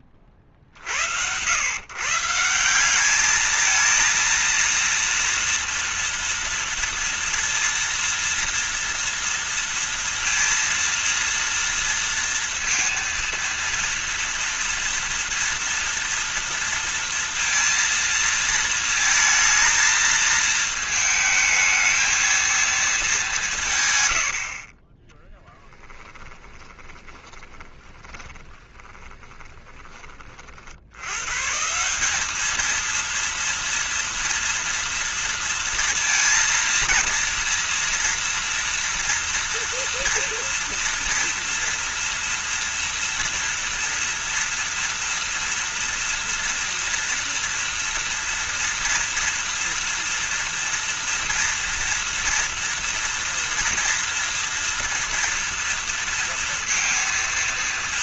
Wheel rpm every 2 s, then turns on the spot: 40, 190, 230, 240, 230, 230, 230, 230, 230, 230, 220, 230, 40, 20, 20, 70, 220, 230, 230, 230, 240, 240, 240, 240, 230, 230, 230, 230, 230.
26-30